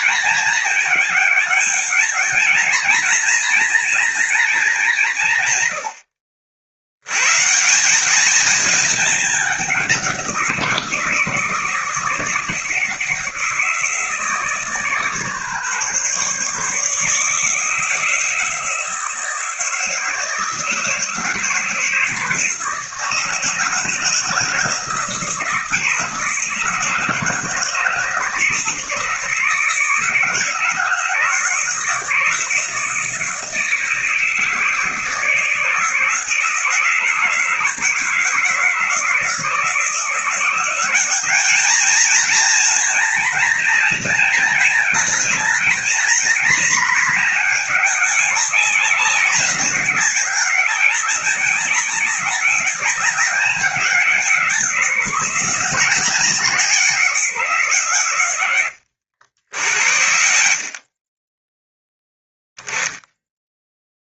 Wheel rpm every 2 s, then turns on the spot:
220, 230, 170, 110, 210, 160, 160, 150, 150, 160, 160, 160, 160, 160, 160, 160, 160, 160, 160, 160, 190, 230, 220, 220, 200, 190, 200, 180, 180, 80, 30, 10.
none